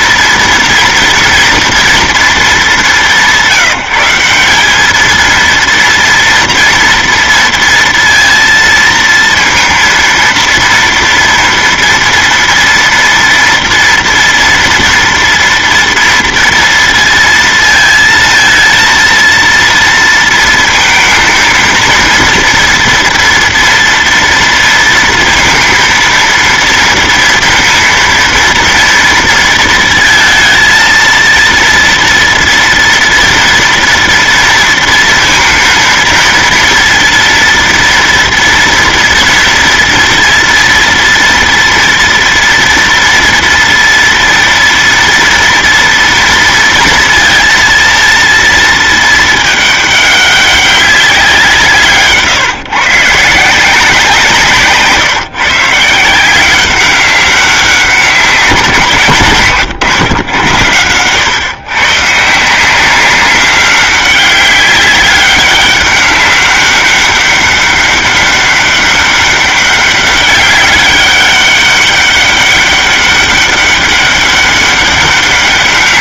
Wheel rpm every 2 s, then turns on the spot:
230, 210, 200, 230, 230, 230, 230, 230, 230, 230, 230, 230, 230, 230, 230, 230, 230, 230, 230, 230, 230, 230, 230, 230, 220, 200, 150, 150, 190, 170, 110, 180, 200, 200, 200, 200, 200, 200.
none